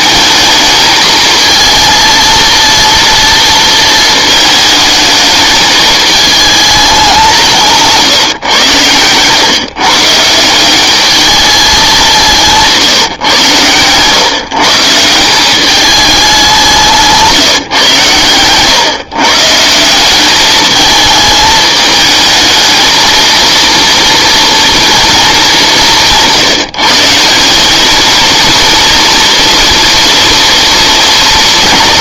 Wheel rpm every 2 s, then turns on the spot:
220, 230, 220, 220, 120, 180, 160, 150, 190, 120, 210, 220, 230, 160, 230, 230.
12-14